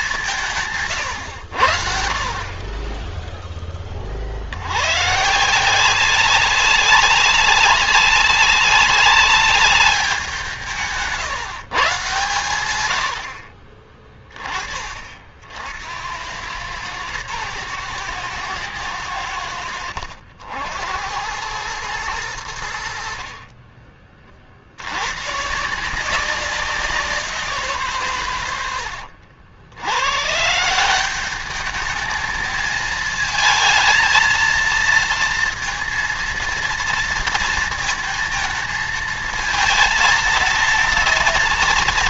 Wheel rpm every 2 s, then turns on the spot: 170, 20, 110, 200, 200, 160, 100, 40, 110, 110, 80, 80, 90, 180, 110, 170, 220, 230, 230, 220, 230.
10-12